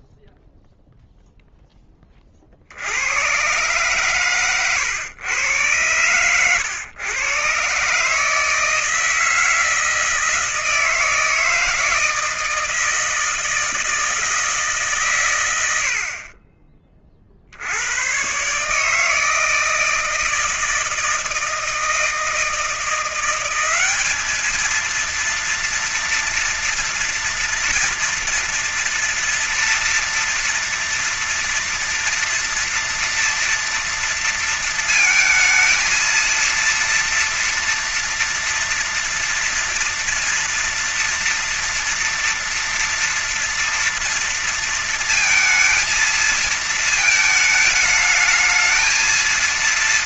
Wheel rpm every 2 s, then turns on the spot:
0, 10, 120, 110, 140, 160, 160, 160, 70, 100, 160, 160, 200, 230, 230, 230, 240, 230, 230, 230, 230, 230, 230, 230, 220.
none